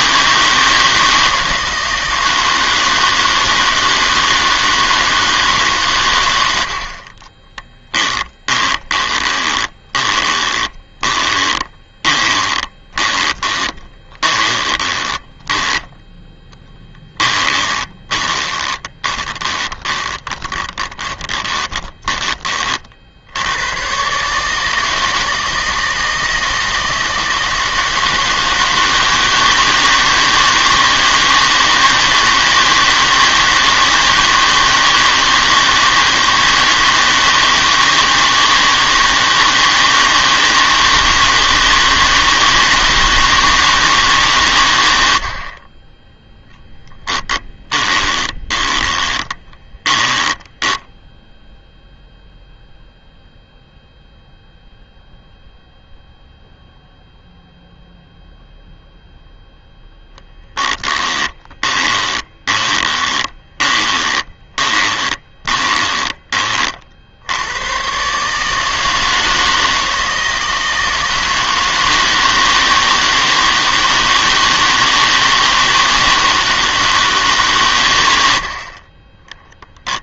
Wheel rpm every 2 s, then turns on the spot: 160, 160, 160, 60, 20, 20, 20, 20, 10, 20, 20, 50, 160, 160, 160, 160, 160, 160, 160, 160, 160, 160, 100, 10, 20, 10, 0, 0, 0, 0, 10, 20, 20, 60, 160, 160, 160, 160, 160, 30.
8-22 46-52 60-66